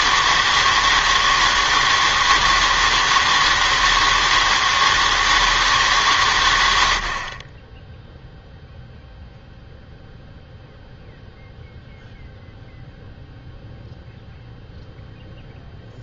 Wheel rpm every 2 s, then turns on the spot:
160, 160, 160, 110, 0, 0, 0, 0.
none